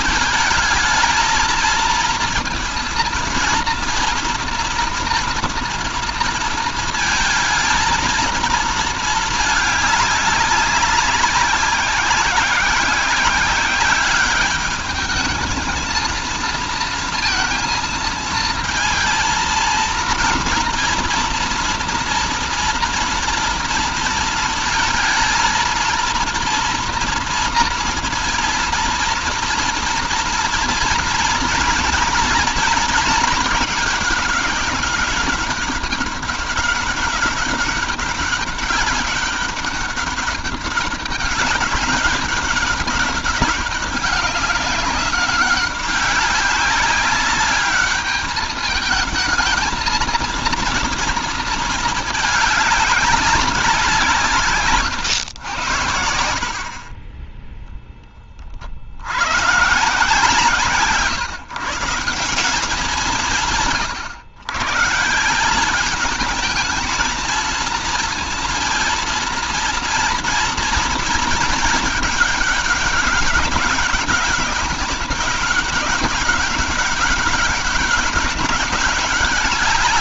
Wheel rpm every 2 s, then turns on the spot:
220, 230, 240, 230, 220, 190, 190, 210, 230, 230, 230, 240, 220, 230, 230, 230, 230, 210, 190, 190, 200, 200, 200, 200, 220, 230, 200, 130, 40, 60, 150, 180, 140, 220, 230, 230, 200, 200, 200, 190.
54-56